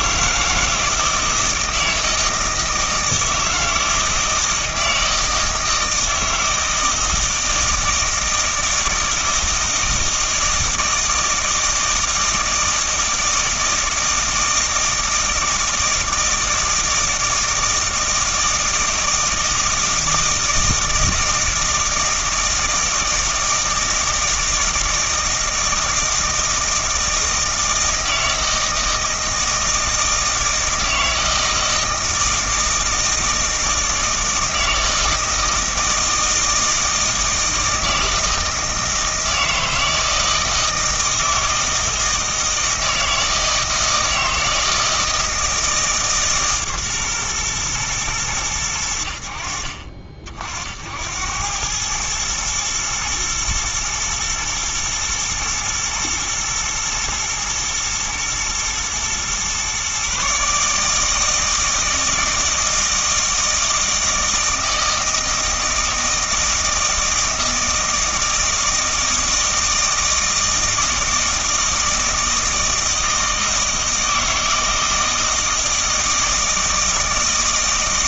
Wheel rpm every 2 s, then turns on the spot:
160, 160, 160, 160, 160, 160, 160, 160, 160, 160, 160, 160, 160, 160, 160, 160, 160, 160, 160, 160, 160, 160, 160, 140, 100, 70, 110, 110, 120, 120, 150, 160, 160, 160, 160, 160, 160, 160, 160.
none